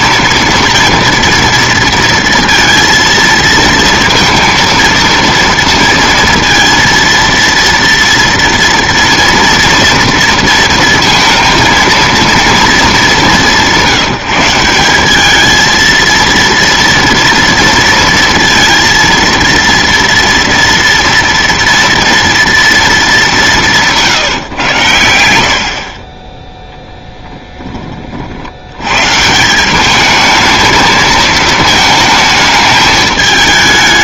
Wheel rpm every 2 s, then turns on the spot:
230, 230, 230, 230, 240, 230, 220, 170, 230, 230, 230, 230, 120, 20, 90, 220, 220.
26-28